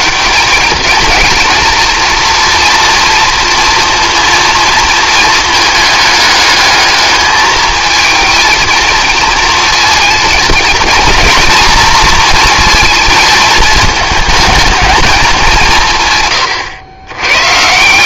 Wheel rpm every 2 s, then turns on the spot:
190, 230, 230, 210, 220, 230, 220, 220, 120.
none